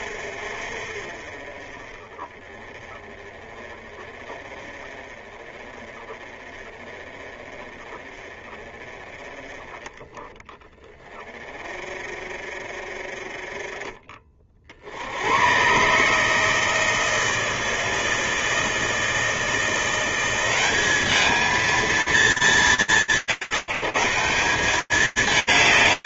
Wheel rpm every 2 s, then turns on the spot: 30, 30, 30, 30, 20, 40, 30, 150, 160, 180, 210, 170, 210.
none